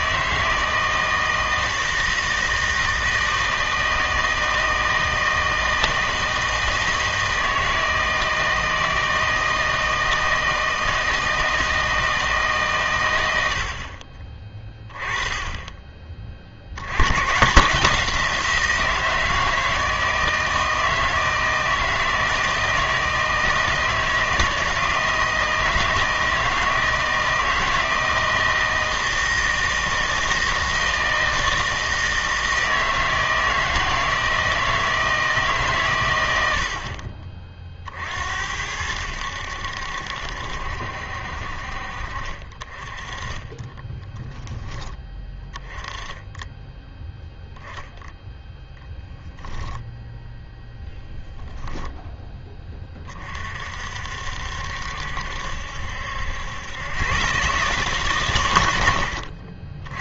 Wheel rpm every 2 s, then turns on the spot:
160, 160, 160, 160, 160, 160, 140, 20, 60, 170, 160, 160, 160, 160, 160, 160, 160, 160, 70, 80, 70, 40, 10, 10, 0, 0, 20, 70, 100, 100.
none